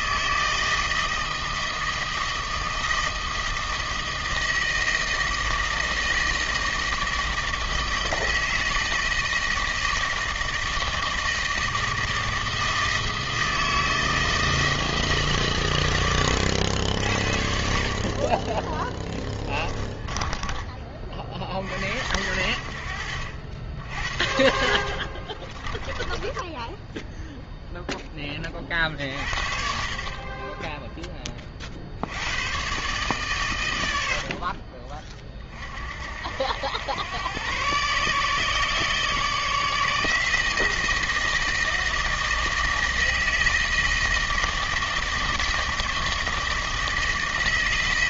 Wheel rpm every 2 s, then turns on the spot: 160, 160, 160, 160, 160, 160, 160, 160, 80, 20, 20, 60, 50, 10, 30, 10, 110, 50, 90, 150, 160, 160, 160, 160.
20-22 24-28